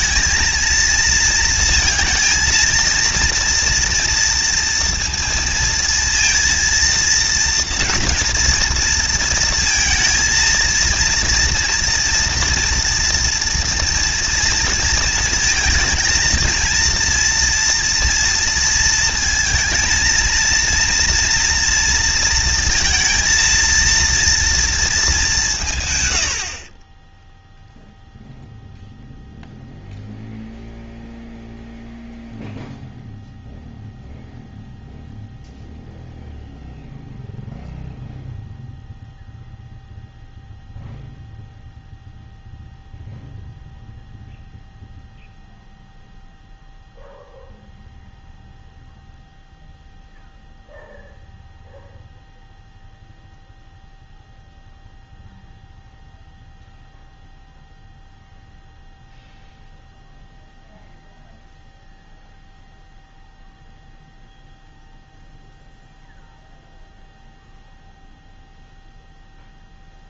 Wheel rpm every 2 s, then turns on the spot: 230, 220, 230, 230, 230, 230, 230, 230, 230, 230, 230, 230, 230, 40, 0, 0, 0, 0, 0, 0, 0, 0, 0, 0, 0, 0, 0, 0, 0, 0, 0, 0, 0, 0, 0.
none